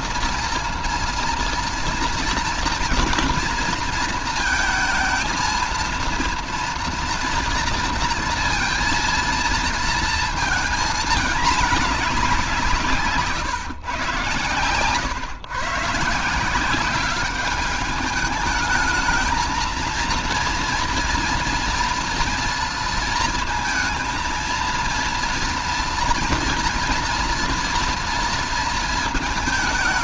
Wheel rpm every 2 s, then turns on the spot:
230, 230, 230, 230, 230, 230, 190, 120, 180, 210, 230, 230, 230, 230, 230.
none